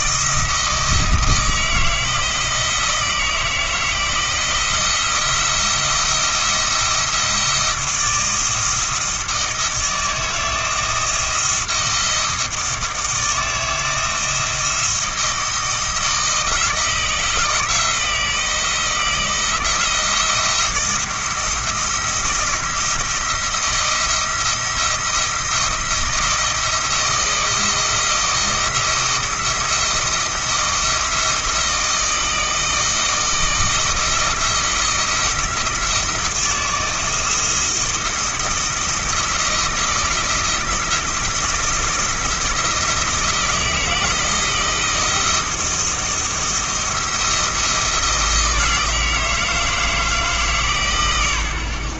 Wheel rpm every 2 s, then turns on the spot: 170, 160, 170, 170, 170, 160, 160, 170, 160, 170, 170, 170, 170, 170, 170, 170, 160, 170, 160, 170, 160, 170, 160, 170, 160, 140.
none